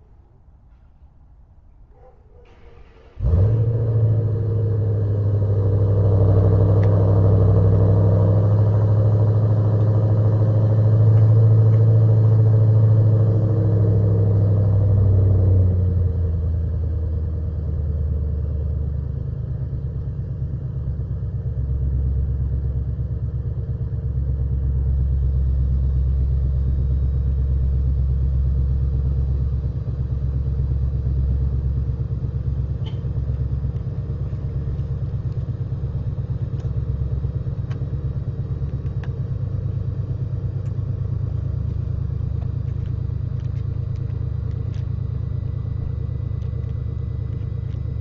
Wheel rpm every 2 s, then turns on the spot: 0, 0, 0, 0, 0, 0, 0, 0, 0, 0, 0, 0, 0, 0, 0, 0, 0, 0, 0, 0, 0, 0, 0, 0.
none